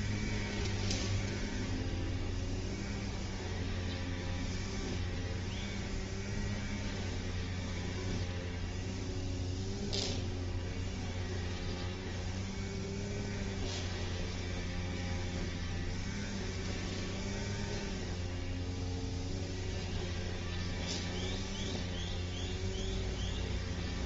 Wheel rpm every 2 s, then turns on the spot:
0, 0, 0, 0, 0, 0, 0, 0, 0, 0, 0, 0.
none